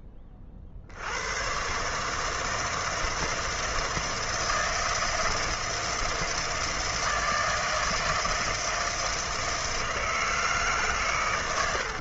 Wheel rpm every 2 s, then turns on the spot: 40, 160, 160, 160, 160, 150.
none